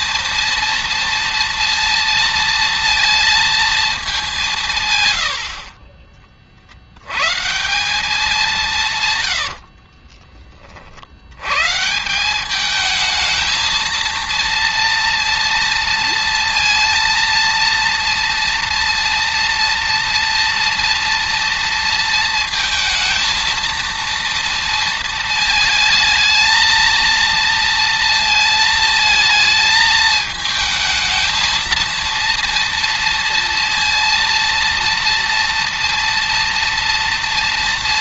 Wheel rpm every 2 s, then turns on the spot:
230, 230, 130, 70, 160, 30, 210, 230, 230, 230, 230, 230, 230, 220, 220, 220, 230, 230, 230.
none